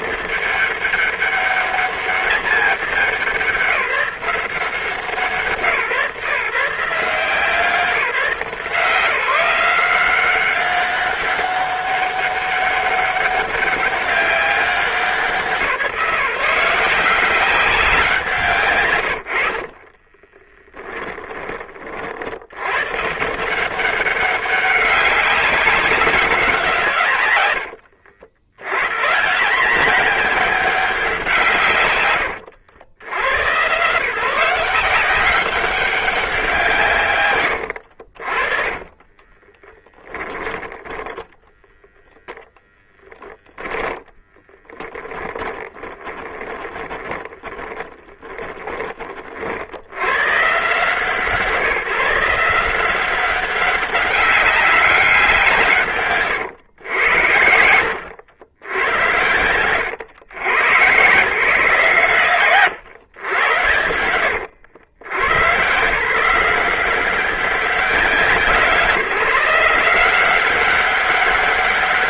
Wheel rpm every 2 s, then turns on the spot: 200, 200, 170, 160, 170, 200, 200, 190, 180, 130, 20, 120, 200, 150, 100, 200, 90, 180, 160, 40, 10, 10, 20, 20, 30, 150, 170, 190, 100, 90, 120, 120, 100, 180, 170, 190.
20-22 38-48 62-64